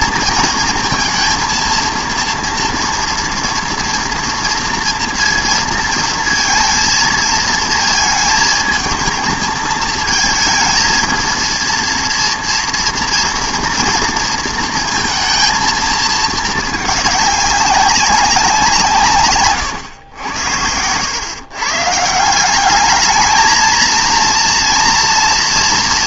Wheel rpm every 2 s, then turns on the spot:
230, 230, 230, 230, 220, 220, 230, 230, 220, 180, 90, 190, 230.
none